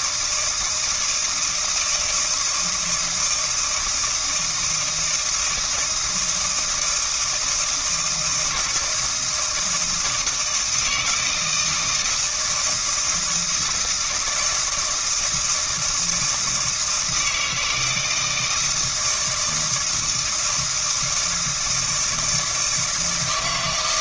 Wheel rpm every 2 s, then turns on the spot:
160, 170, 160, 160, 160, 160, 160, 160, 160, 160, 160, 160.
none